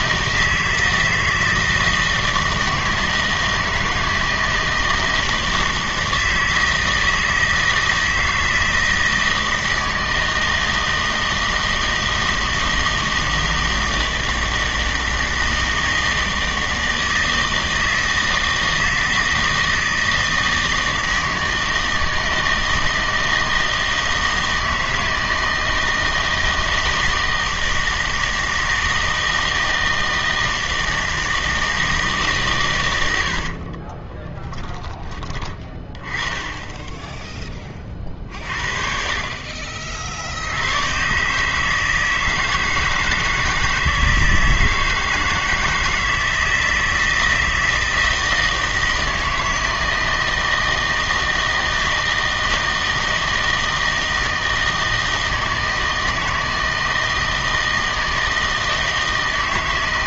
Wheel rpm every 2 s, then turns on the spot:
160, 160, 160, 160, 160, 160, 160, 160, 160, 160, 160, 160, 160, 160, 160, 160, 130, 10, 10, 40, 90, 160, 160, 160, 160, 160, 160, 160, 160, 160.
none